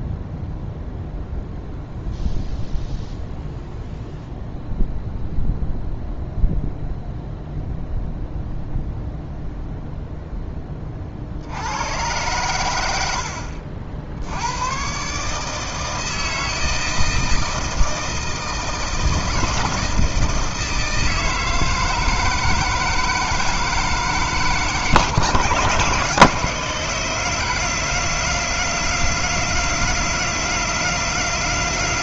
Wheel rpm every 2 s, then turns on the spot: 0, 0, 0, 0, 0, 10, 90, 120, 160, 160, 160, 160, 150, 160, 170, 170.
none